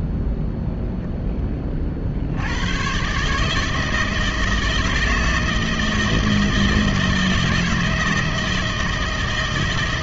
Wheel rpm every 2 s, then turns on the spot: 0, 110, 160, 160, 160.
none